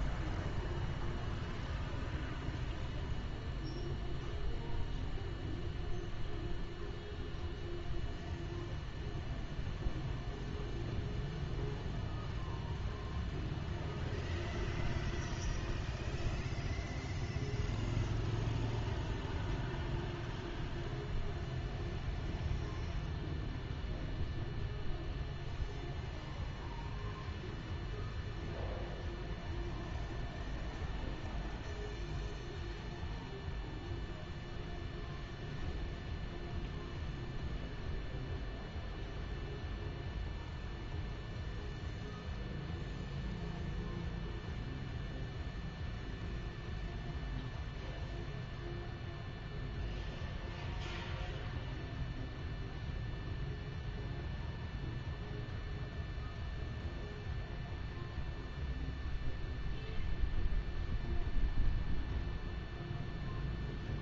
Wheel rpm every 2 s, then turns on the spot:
0, 0, 0, 0, 0, 0, 0, 0, 0, 0, 0, 0, 0, 0, 0, 0, 0, 0, 0, 0, 0, 0, 0, 0, 0, 0, 0, 0, 0, 0, 0, 0.
none